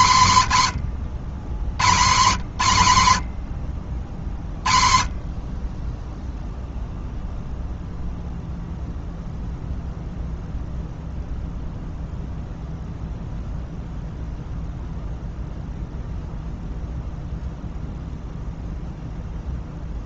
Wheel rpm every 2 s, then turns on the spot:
190, 140, 40, 0, 0, 0, 0, 0, 0, 0.
none